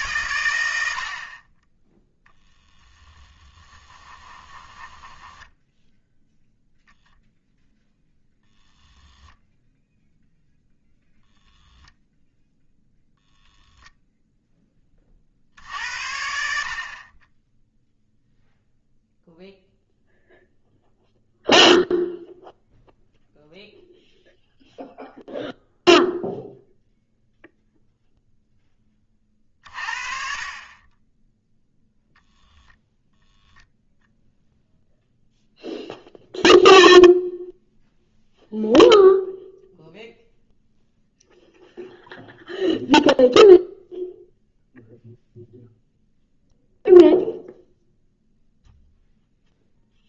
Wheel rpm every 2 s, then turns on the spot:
90, 10, 10, 0, 0, 0, 0, 10, 60, 0, 0, 0, 0, 0, 10, 30, 0, 0, 0, 0, 0, 0, 0, 0, 0.
2-6